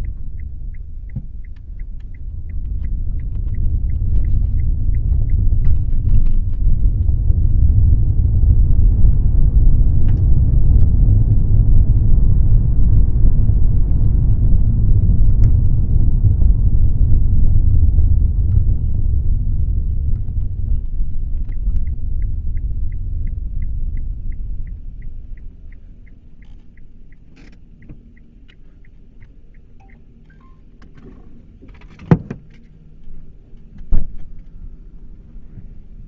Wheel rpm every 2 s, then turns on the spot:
0, 0, 0, 0, 0, 0, 0, 0, 0, 0, 0, 0, 0, 0, 0, 0, 0, 0.
none